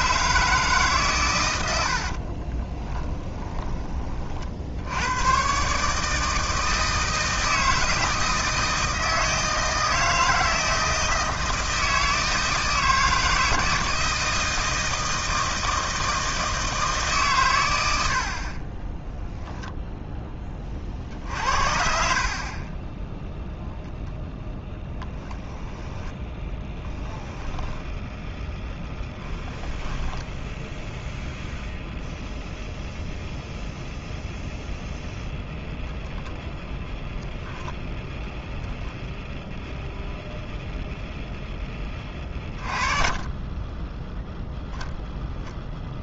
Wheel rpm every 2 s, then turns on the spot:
140, 20, 80, 160, 160, 160, 160, 160, 150, 20, 40, 20, 10, 10, 0, 0, 0, 0, 10, 0, 0, 30, 0.
2-4 24-28 42-44